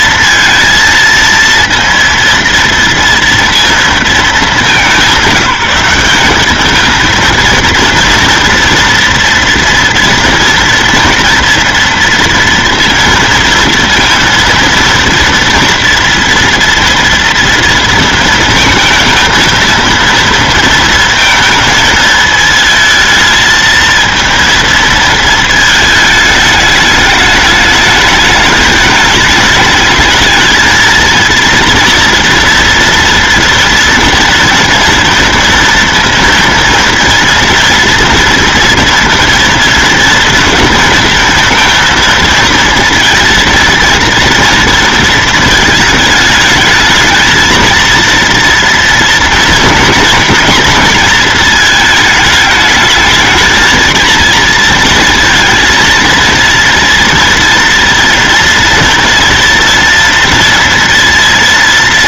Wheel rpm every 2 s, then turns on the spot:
230, 230, 180, 210, 230, 230, 230, 230, 230, 220, 220, 220, 230, 210, 210, 220, 230, 230, 230, 230, 230, 230, 230, 220, 230, 230, 220, 230, 230, 230, 230.
none